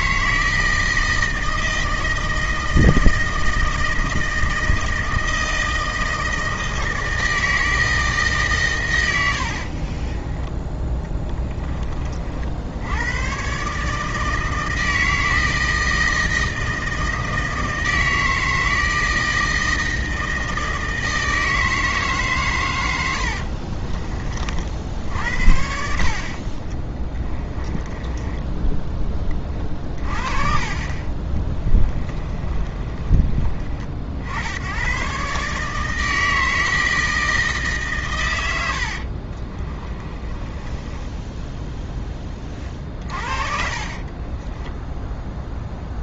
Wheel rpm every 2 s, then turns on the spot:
160, 160, 160, 160, 110, 10, 90, 160, 160, 160, 160, 100, 50, 20, 10, 30, 30, 100, 160, 70, 20, 40, 10.
10-12 26-28 32-34 38-46